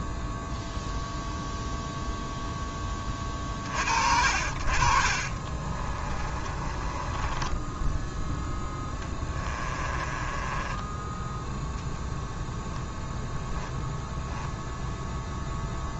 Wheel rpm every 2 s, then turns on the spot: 0, 10, 50, 30, 10, 10, 0, 0.
6-8 10-12